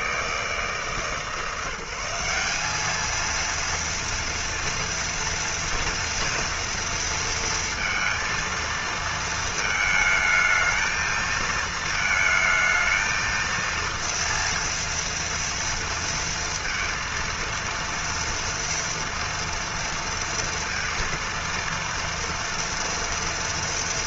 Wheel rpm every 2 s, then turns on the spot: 160, 200, 230, 230, 230, 220, 220, 230, 230, 230, 230, 230.
none